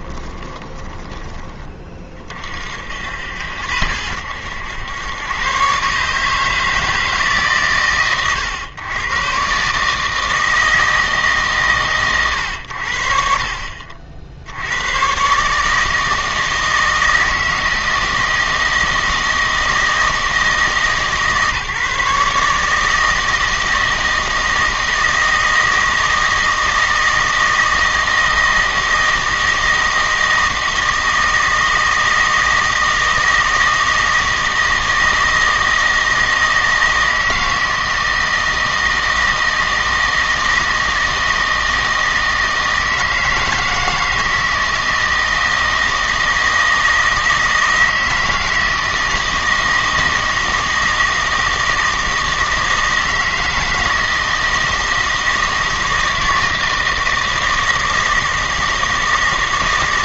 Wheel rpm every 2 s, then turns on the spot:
20, 60, 90, 160, 120, 160, 90, 90, 160, 160, 150, 150, 160, 160, 160, 160, 160, 160, 160, 160, 160, 160, 160, 160, 160, 160, 160, 160, 160, 160.
0-2